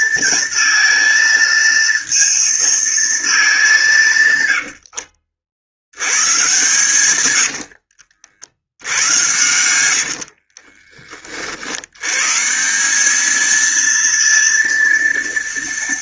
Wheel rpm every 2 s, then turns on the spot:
230, 220, 60, 110, 90, 30, 190, 230.
6-8